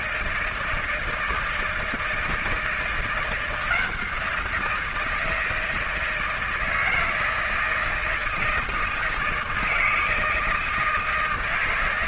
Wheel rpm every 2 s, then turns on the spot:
160, 160, 170, 160, 160, 160.
none